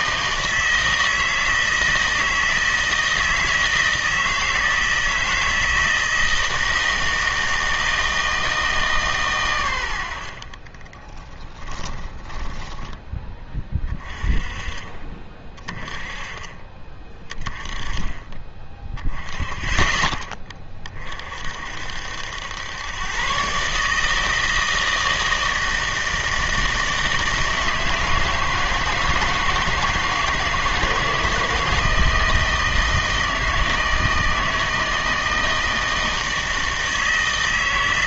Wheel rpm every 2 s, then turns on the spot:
160, 160, 160, 160, 160, 30, 10, 40, 30, 20, 30, 110, 160, 160, 160, 160, 160, 160, 160.
10-14